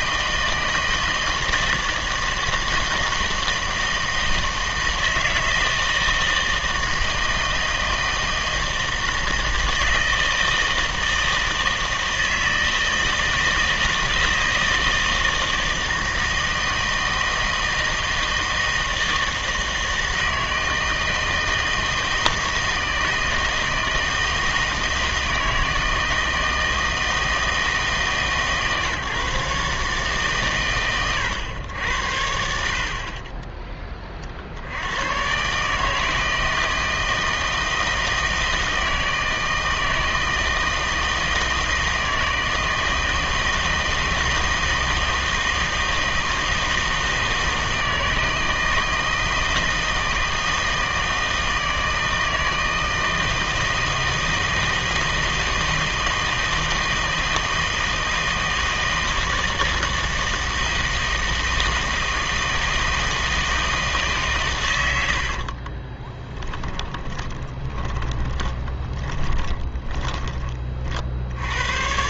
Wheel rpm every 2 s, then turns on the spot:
160, 160, 160, 160, 160, 160, 160, 160, 160, 160, 160, 160, 160, 160, 150, 120, 50, 70, 160, 160, 160, 160, 160, 160, 160, 160, 160, 160, 160, 160, 160, 160, 110, 10, 20, 40.
66-70